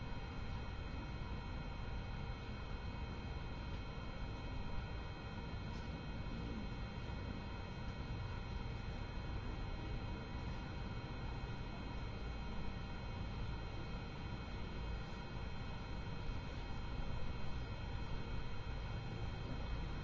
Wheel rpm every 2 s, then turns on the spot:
0, 0, 0, 0, 0, 0, 0, 0, 0, 0.
none